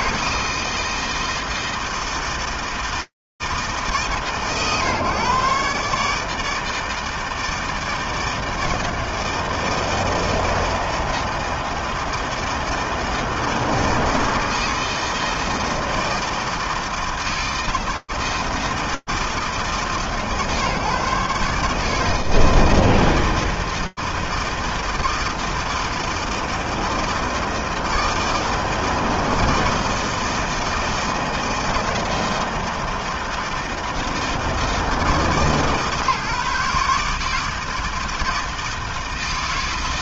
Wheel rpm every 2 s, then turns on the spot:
160, 160, 130, 160, 160, 160, 160, 160, 160, 160, 140, 160, 160, 160, 160, 160, 160, 160, 140, 160.
none